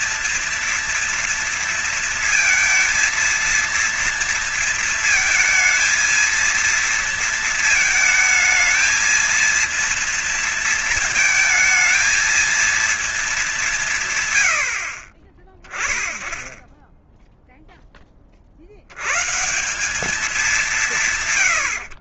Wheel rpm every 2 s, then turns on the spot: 230, 230, 230, 230, 220, 230, 220, 60, 10, 70, 170.
none